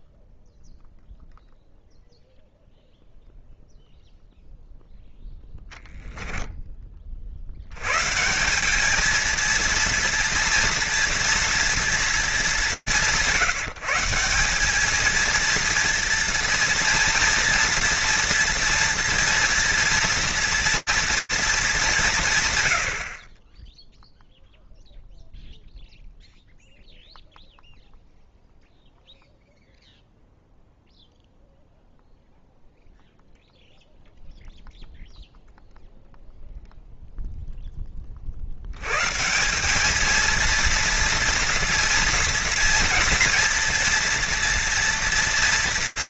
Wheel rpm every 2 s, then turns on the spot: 0, 0, 0, 40, 220, 230, 160, 230, 230, 230, 230, 50, 0, 0, 0, 0, 0, 0, 0, 110, 230, 230, 240.
none